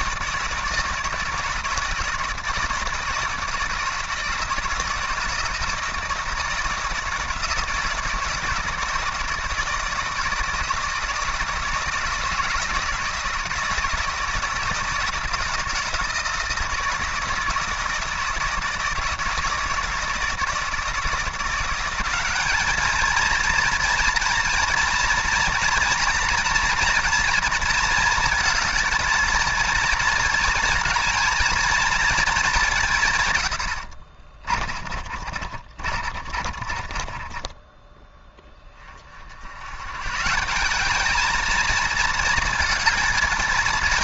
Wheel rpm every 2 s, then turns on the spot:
160, 160, 160, 170, 160, 160, 160, 160, 160, 160, 160, 210, 230, 240, 230, 220, 190, 40, 30, 30, 190, 220.
34-38